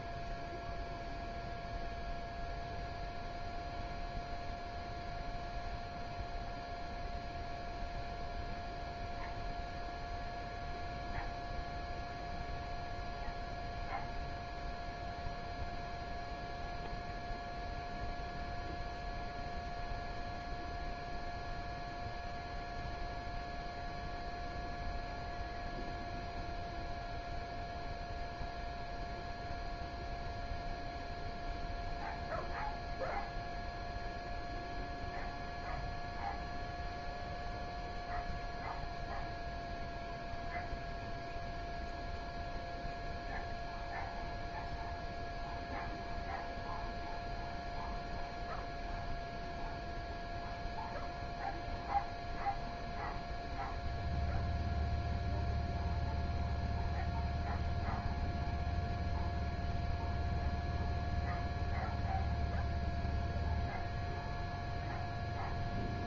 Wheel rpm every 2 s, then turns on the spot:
0, 0, 0, 0, 0, 0, 0, 0, 0, 0, 0, 0, 0, 0, 0, 0, 0, 0, 0, 0, 0, 0, 0, 0, 0, 0, 0, 0, 0, 0, 0, 0, 0.
none